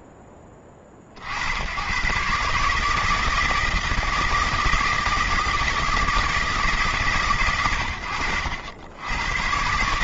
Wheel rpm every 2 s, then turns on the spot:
90, 160, 160, 120, 110.
none